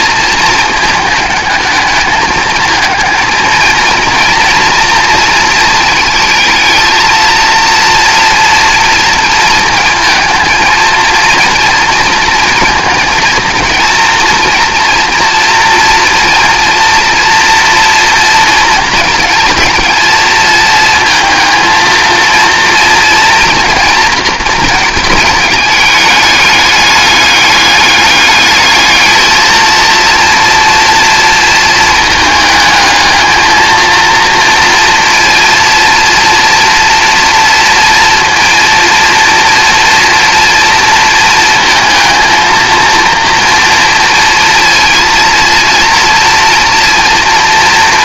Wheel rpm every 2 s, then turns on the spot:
220, 220, 230, 220, 230, 220, 220, 230, 230, 230, 220, 230, 220, 210, 210, 230, 220, 230, 240, 230, 230, 230, 230, 230.
none